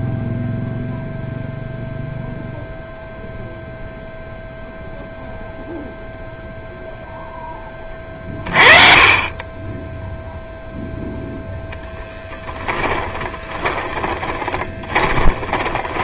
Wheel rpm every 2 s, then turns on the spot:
0, 0, 0, 0, 30, 0, 20, 20.
12-16